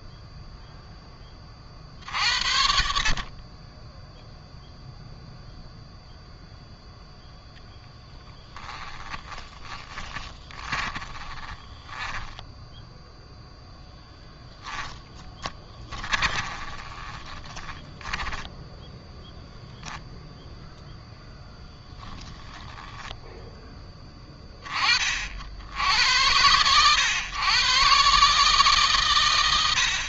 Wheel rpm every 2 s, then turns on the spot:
0, 50, 0, 0, 10, 20, 10, 10, 20, 10, 10, 0, 30, 100, 130.
8-20